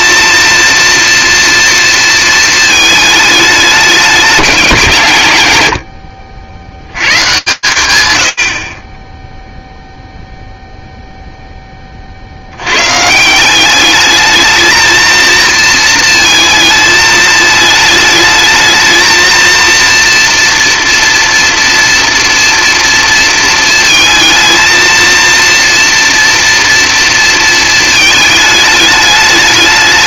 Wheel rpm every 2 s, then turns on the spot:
230, 210, 160, 130, 0, 0, 150, 220, 220, 230, 230, 230, 230, 230, 210.
none